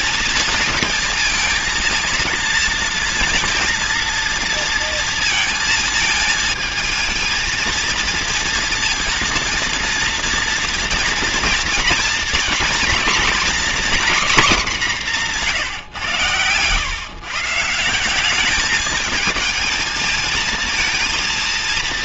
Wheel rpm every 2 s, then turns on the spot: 230, 230, 230, 230, 230, 230, 230, 220, 130, 210, 230.
none